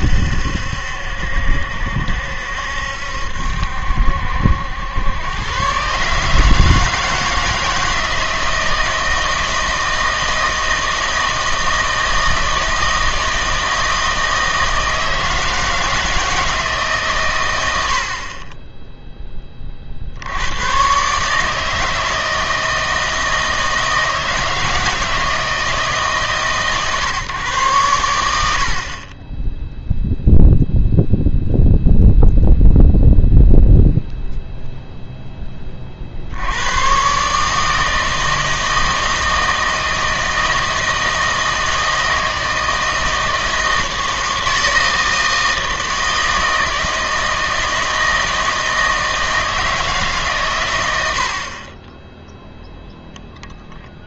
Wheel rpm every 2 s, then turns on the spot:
70, 70, 80, 160, 160, 160, 160, 160, 150, 20, 110, 160, 160, 140, 70, 0, 0, 0, 100, 160, 160, 160, 160, 160, 160, 110, 0.
none